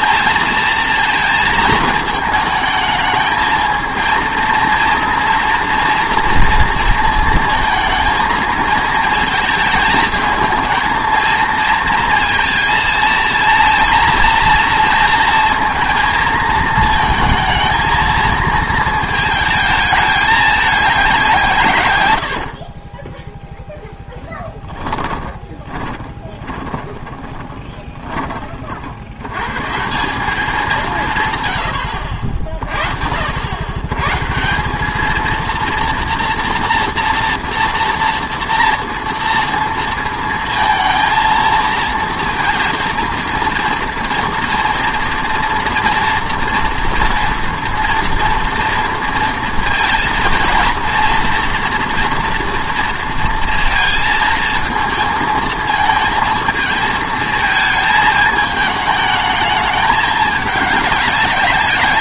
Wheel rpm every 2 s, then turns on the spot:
230, 220, 230, 230, 220, 220, 230, 230, 230, 220, 210, 40, 10, 20, 50, 190, 50, 190, 230, 230, 230, 230, 230, 230, 230, 230, 230, 230, 220, 210, 200.
24-28